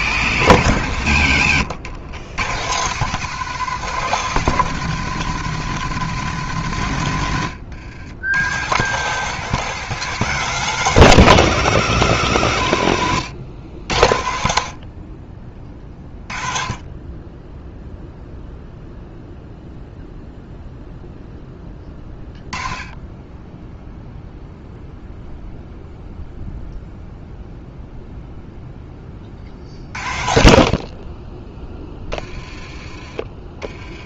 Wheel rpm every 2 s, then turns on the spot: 110, 140, 160, 120, 140, 170, 110, 50, 20, 0, 0, 20, 0, 0, 10, 40, 20.
none